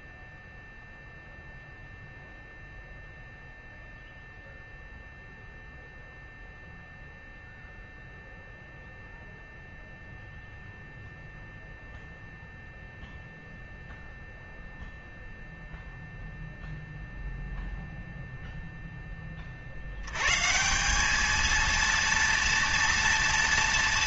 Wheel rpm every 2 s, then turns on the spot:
0, 0, 0, 0, 0, 0, 0, 0, 0, 0, 170, 230.
none